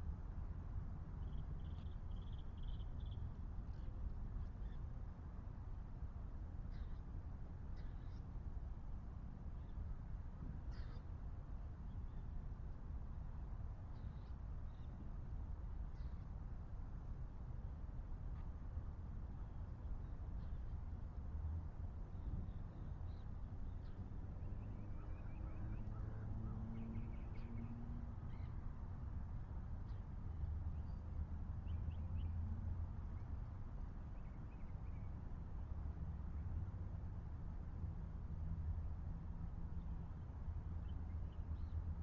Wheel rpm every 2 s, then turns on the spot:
0, 0, 0, 0, 0, 0, 0, 0, 0, 0, 0, 0, 0, 0, 0, 0, 0, 0, 0, 0, 0.
none